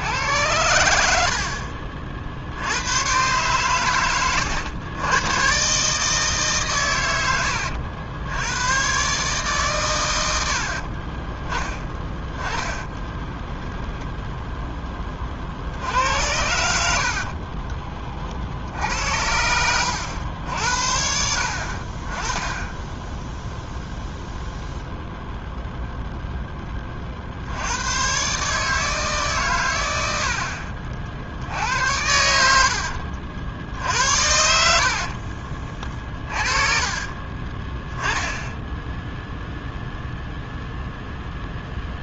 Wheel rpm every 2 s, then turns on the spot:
80, 90, 110, 120, 120, 40, 20, 10, 80, 70, 70, 10, 0, 20, 150, 50, 70, 70, 30, 0, 0.
12-14 16-18 32-38